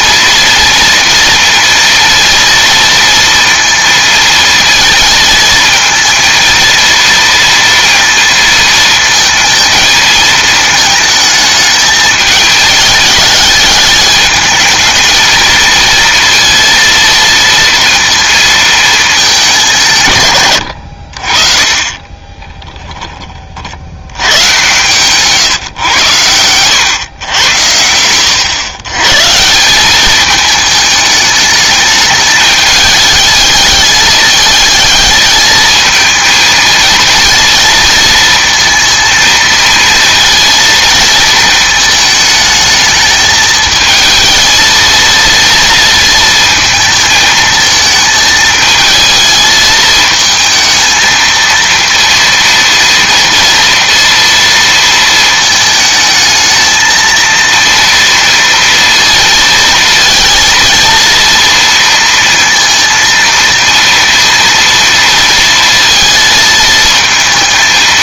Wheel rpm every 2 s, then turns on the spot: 230, 230, 220, 230, 230, 220, 210, 220, 230, 220, 100, 20, 110, 110, 120, 210, 210, 220, 230, 230, 220, 220, 220, 230, 220, 230, 230, 230, 220, 230, 230, 230, 230, 220.
22-24